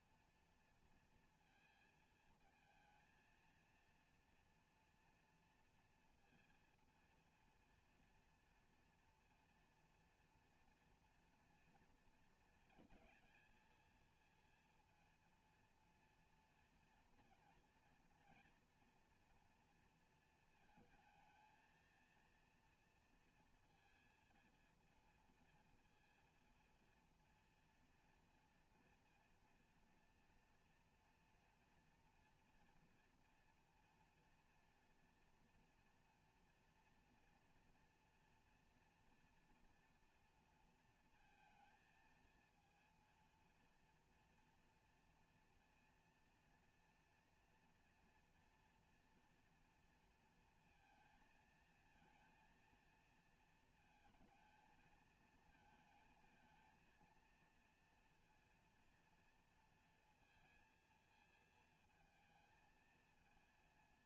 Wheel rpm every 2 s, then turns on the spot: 230, 230, 240, 230, 230, 230, 220, 230, 230, 230, 220, 230, 230, 230, 230, 230, 240, 240, 240, 240, 230, 230, 230, 230, 230, 230, 230, 230, 220, 230, 230, 220.
none